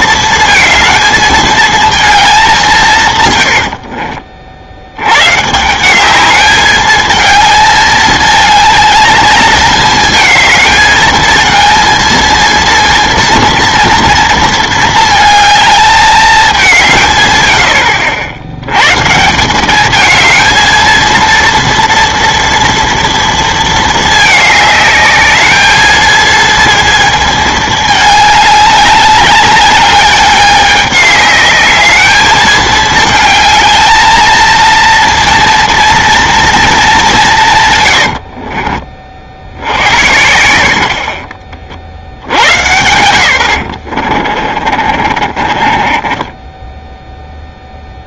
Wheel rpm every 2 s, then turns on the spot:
230, 200, 60, 210, 220, 220, 230, 230, 200, 100, 220, 230, 210, 230, 210, 200, 220, 230, 230, 40, 70, 120, 50, 10.
38-40 44-48